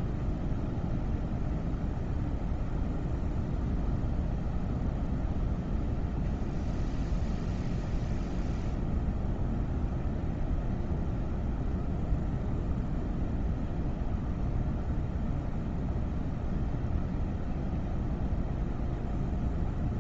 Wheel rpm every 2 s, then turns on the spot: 0, 0, 0, 0, 0, 0, 0, 0, 0, 0.
none